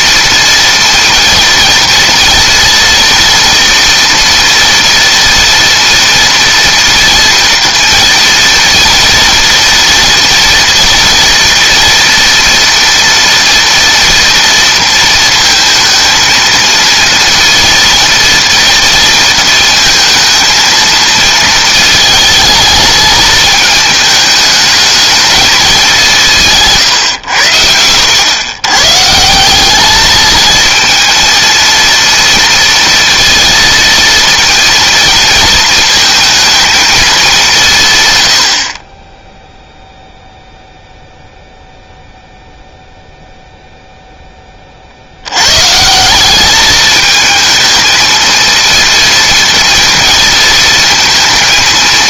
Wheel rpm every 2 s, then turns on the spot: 230, 230, 230, 230, 230, 230, 230, 230, 230, 230, 230, 220, 220, 130, 130, 220, 230, 230, 230, 50, 0, 0, 50, 210, 230, 230.
none